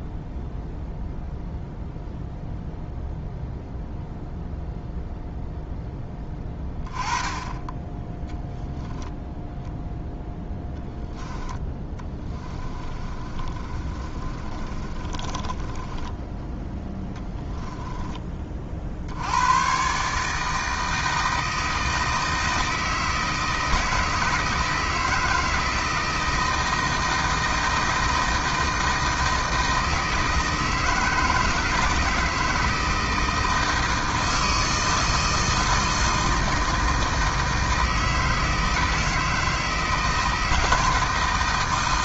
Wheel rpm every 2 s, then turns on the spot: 0, 0, 0, 10, 0, 10, 30, 30, 10, 50, 160, 160, 160, 160, 160, 160, 160, 160, 160, 160, 160.
10-16